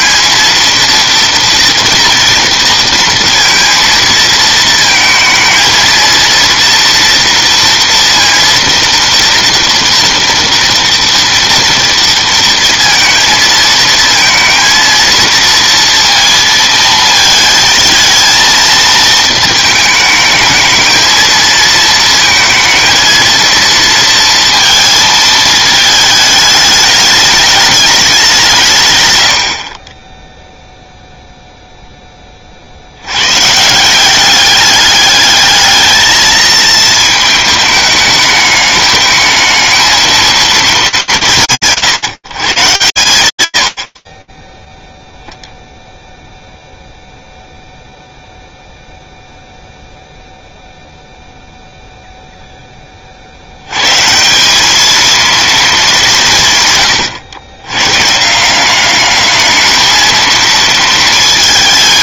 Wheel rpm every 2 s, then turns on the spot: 230, 230, 220, 230, 230, 230, 230, 230, 230, 230, 220, 230, 230, 210, 140, 0, 70, 200, 220, 210, 190, 140, 0, 0, 0, 0, 80, 230, 100, 210, 220.
none